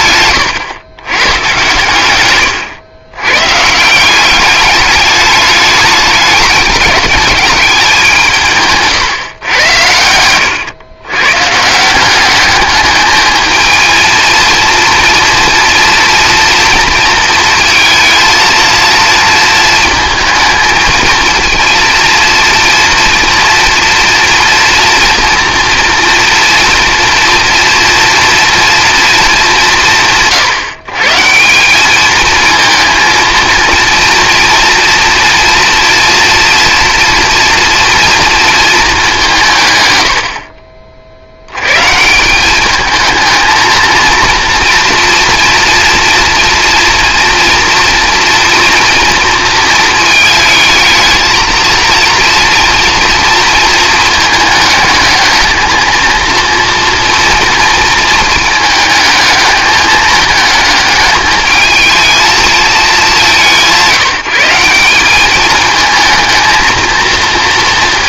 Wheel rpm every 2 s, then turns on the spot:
110, 110, 200, 200, 150, 110, 210, 240, 230, 230, 230, 230, 240, 230, 230, 150, 230, 240, 230, 220, 40, 210, 230, 230, 230, 220, 230, 210, 230, 220, 220, 220, 190, 230.
none